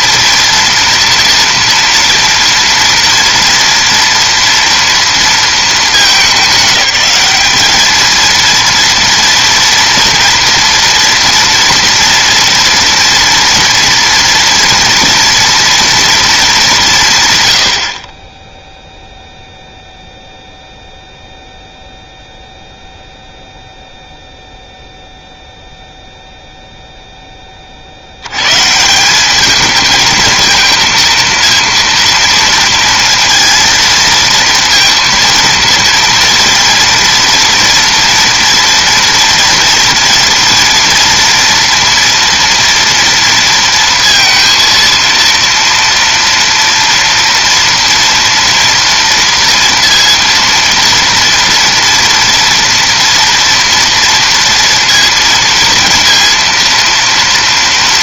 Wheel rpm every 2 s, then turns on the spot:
230, 230, 230, 210, 230, 230, 230, 230, 190, 0, 0, 0, 0, 0, 150, 230, 230, 230, 230, 230, 230, 230, 230, 230, 230, 230, 230, 230, 230.
none